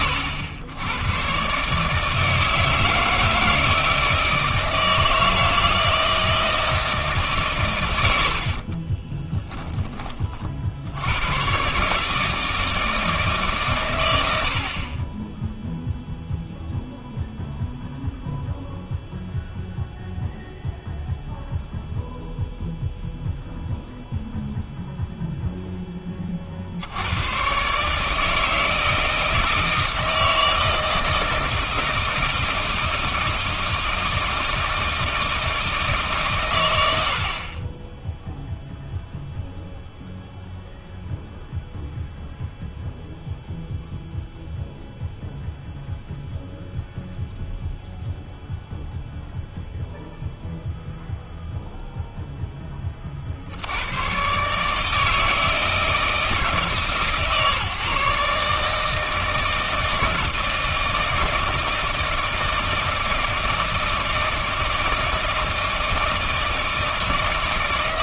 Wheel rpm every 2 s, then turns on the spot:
110, 160, 160, 160, 30, 70, 160, 40, 0, 0, 0, 0, 0, 60, 160, 160, 160, 160, 110, 0, 0, 0, 0, 0, 0, 0, 20, 150, 150, 150, 160, 160, 160, 160.
8-10